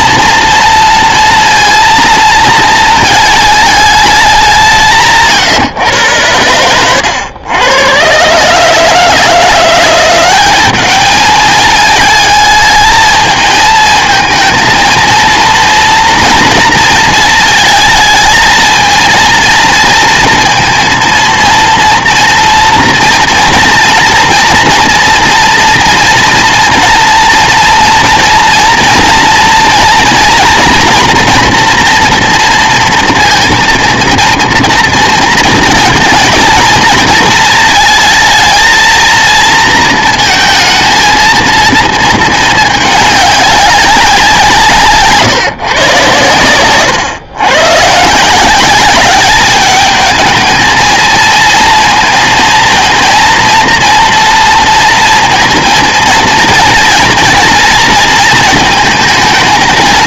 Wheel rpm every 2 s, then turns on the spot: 230, 230, 170, 90, 150, 200, 220, 230, 230, 220, 230, 230, 230, 230, 230, 240, 230, 230, 220, 230, 220, 220, 160, 110, 180, 220, 230, 230, 230, 230.
none